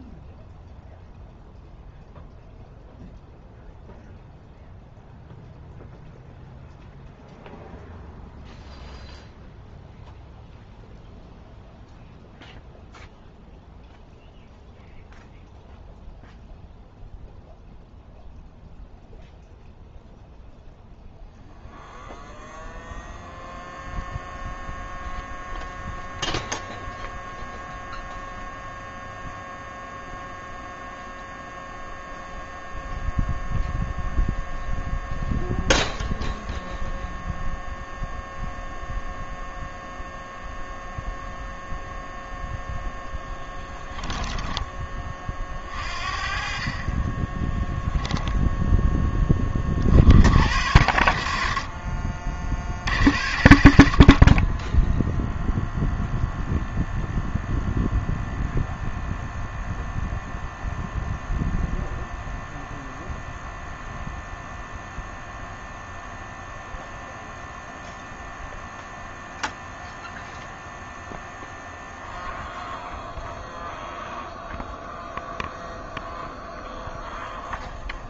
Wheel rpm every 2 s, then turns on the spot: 0, 0, 0, 0, 0, 0, 0, 0, 0, 0, 0, 0, 0, 0, 0, 0, 0, 0, 0, 0, 0, 0, 20, 40, 10, 70, 60, 10, 0, 0, 0, 0, 0, 0, 0, 0, 0, 0, 0.
46-48